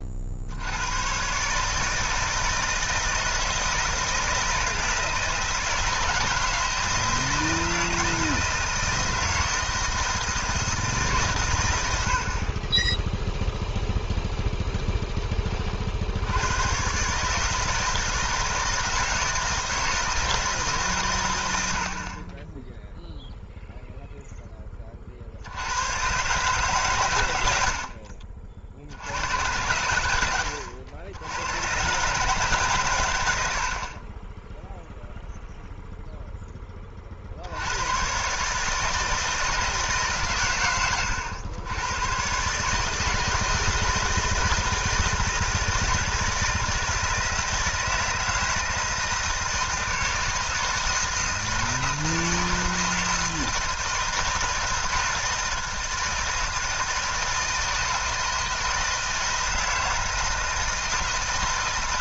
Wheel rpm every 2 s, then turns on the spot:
80, 160, 160, 160, 160, 160, 20, 0, 110, 160, 160, 0, 20, 140, 50, 90, 130, 0, 20, 150, 110, 150, 160, 160, 160, 160, 160, 160, 160, 160, 160.
none